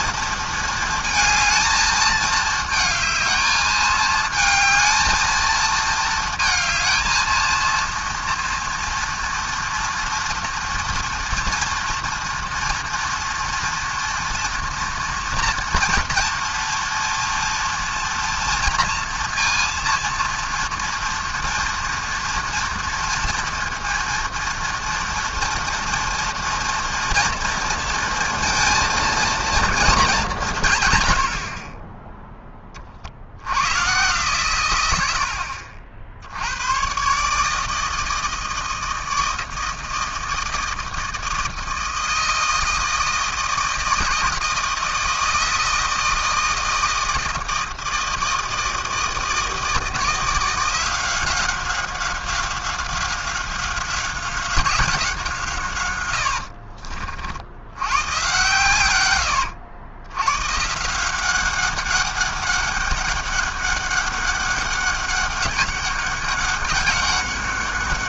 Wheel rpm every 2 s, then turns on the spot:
220, 220, 220, 230, 230, 240, 230, 230, 230, 230, 230, 230, 230, 230, 230, 140, 30, 110, 110, 160, 160, 160, 160, 160, 160, 180, 190, 180, 60, 120, 150, 200, 200, 200.
56-58